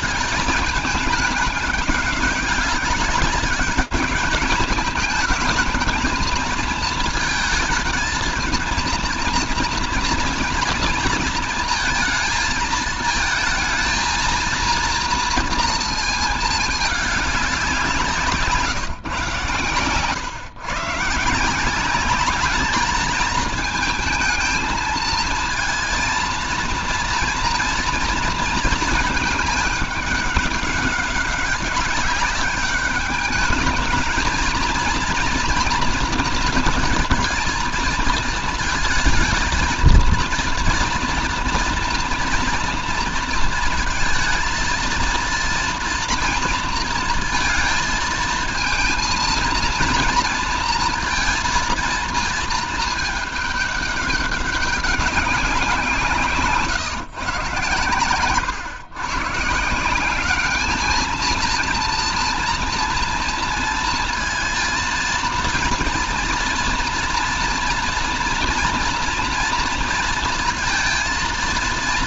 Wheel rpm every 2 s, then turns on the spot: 210, 200, 210, 220, 230, 230, 220, 230, 220, 140, 130, 210, 220, 230, 220, 200, 200, 220, 230, 230, 230, 230, 230, 230, 230, 230, 220, 200, 150, 120, 220, 230, 230, 240, 230, 230.
none